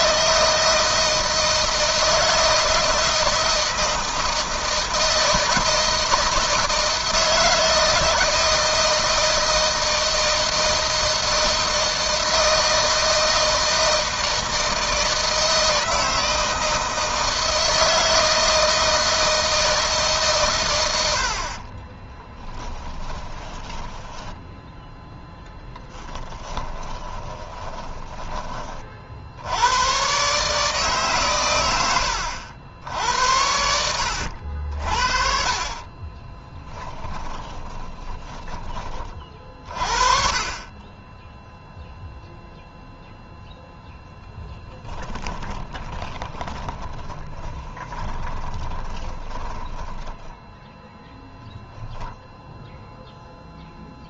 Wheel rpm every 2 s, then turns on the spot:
170, 160, 160, 160, 160, 160, 160, 160, 160, 160, 90, 10, 0, 10, 50, 140, 80, 60, 20, 30, 20, 0, 10, 20, 20, 0, 0.
22-24 26-28 36-38 44-50